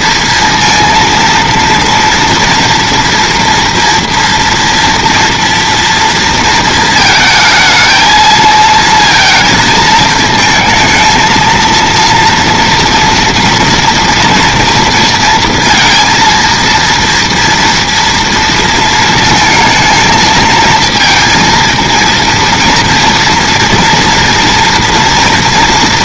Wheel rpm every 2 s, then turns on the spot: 230, 230, 230, 230, 220, 220, 230, 230, 230, 230, 230, 230, 230.
none